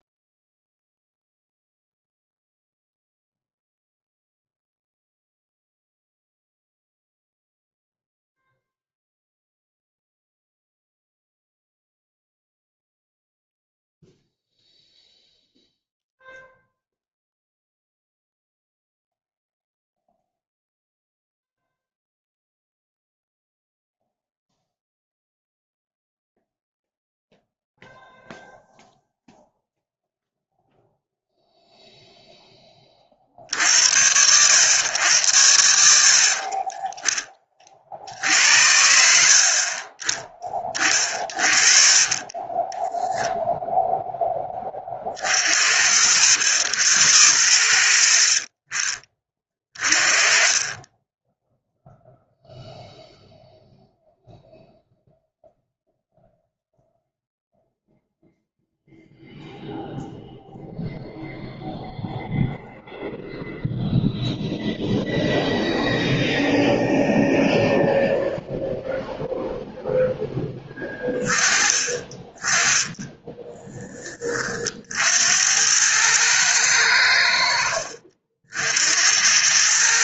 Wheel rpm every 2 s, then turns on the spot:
0, 0, 0, 0, 0, 0, 0, 0, 0, 0, 0, 0, 0, 0, 0, 0, 20, 100, 30, 80, 30, 20, 20, 80, 40, 30, 0, 0, 0, 0, 0, 0, 0, 0, 0, 10, 20, 60, 100, 70.
36-38